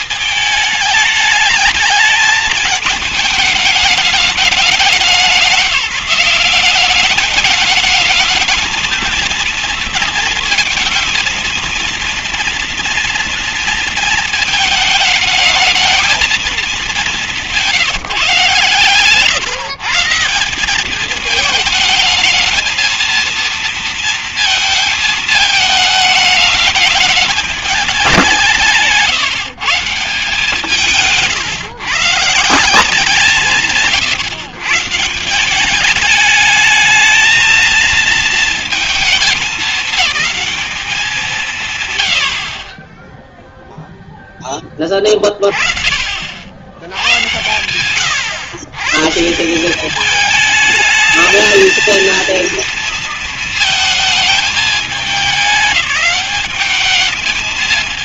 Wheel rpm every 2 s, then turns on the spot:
210, 220, 190, 190, 230, 220, 230, 220, 210, 140, 190, 220, 220, 210, 170, 150, 170, 140, 220, 230, 210, 40, 10, 50, 110, 210, 230, 220, 200.
none